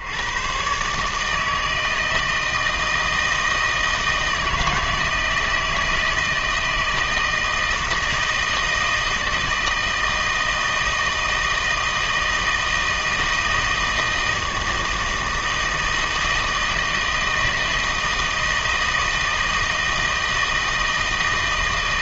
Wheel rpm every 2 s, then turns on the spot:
110, 160, 160, 160, 160, 160, 160, 160, 160, 160, 160.
none